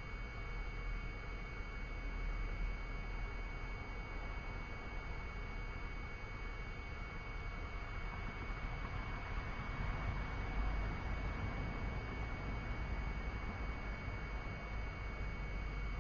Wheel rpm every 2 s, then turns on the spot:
0, 0, 0, 0, 0, 0, 0, 0.
none